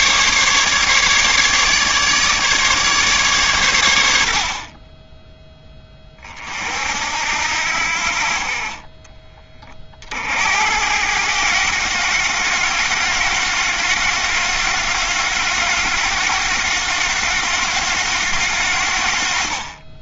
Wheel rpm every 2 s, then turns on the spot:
150, 140, 40, 60, 30, 80, 90, 90, 90, 70.
8-10